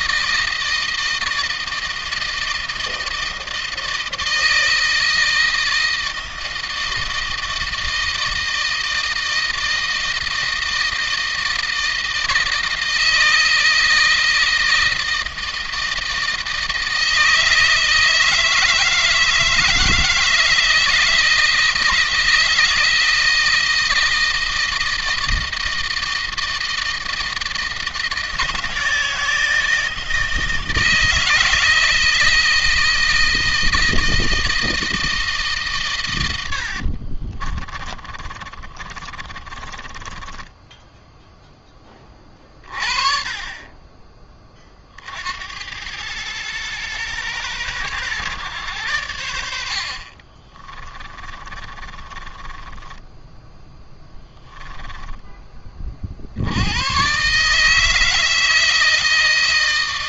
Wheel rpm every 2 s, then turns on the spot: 160, 160, 160, 160, 160, 160, 160, 160, 160, 160, 160, 160, 160, 160, 160, 160, 160, 160, 70, 30, 10, 40, 40, 110, 110, 30, 10, 10, 90, 160.
36-42 50-56